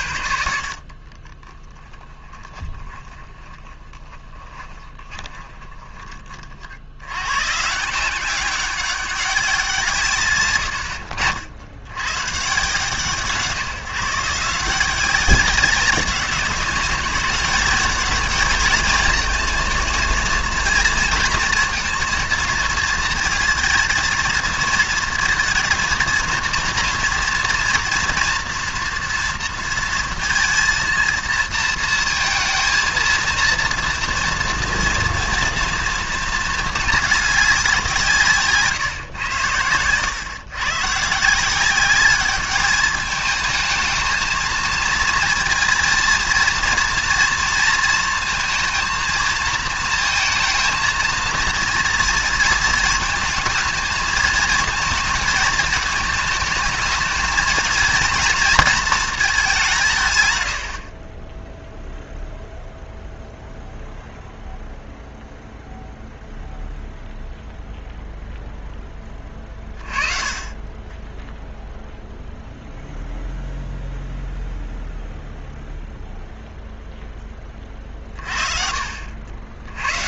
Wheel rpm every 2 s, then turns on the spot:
60, 20, 20, 70, 200, 100, 140, 170, 200, 220, 230, 230, 230, 230, 230, 230, 230, 230, 220, 140, 130, 210, 220, 230, 220, 220, 220, 220, 220, 230, 90, 0, 0, 0, 10, 20, 0, 0, 0, 50.
2-6